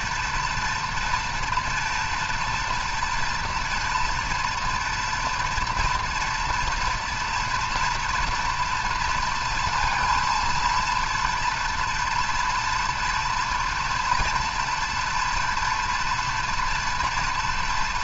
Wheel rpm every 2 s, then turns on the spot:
230, 230, 230, 240, 230, 230, 230, 230, 230.
none